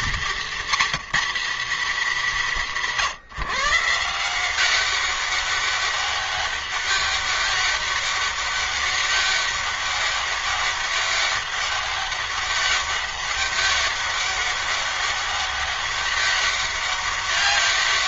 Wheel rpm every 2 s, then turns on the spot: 230, 170, 190, 200, 200, 200, 200, 200, 190.
none